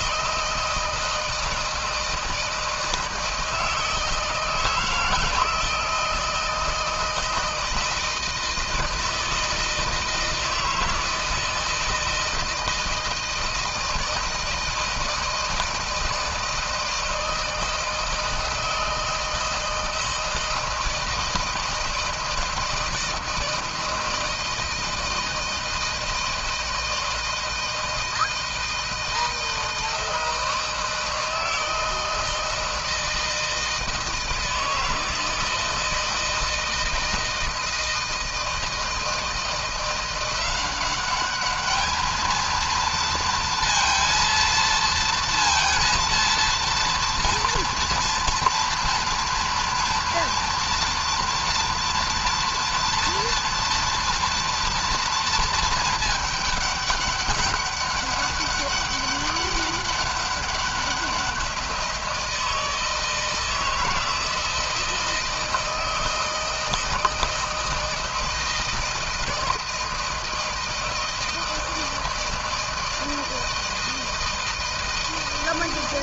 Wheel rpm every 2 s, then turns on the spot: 160, 160, 160, 160, 160, 160, 160, 160, 160, 160, 160, 160, 160, 160, 160, 160, 160, 160, 160, 160, 200, 230, 230, 230, 240, 230, 240, 230, 200, 200, 190, 160, 160, 160, 160, 160, 160, 160.
none